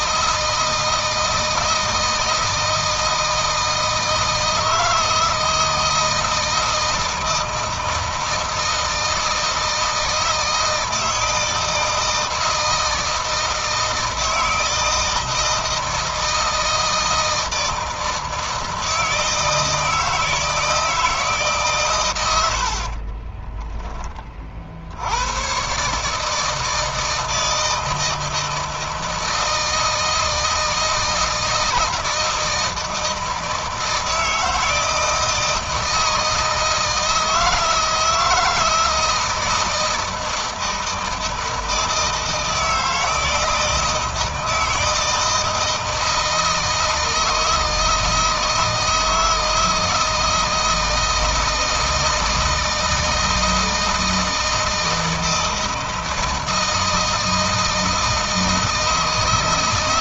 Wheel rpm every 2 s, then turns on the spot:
160, 160, 160, 160, 160, 160, 160, 160, 160, 160, 160, 30, 70, 160, 160, 160, 160, 160, 160, 160, 160, 160, 160, 160, 160, 160, 160, 160, 160, 160.
22-24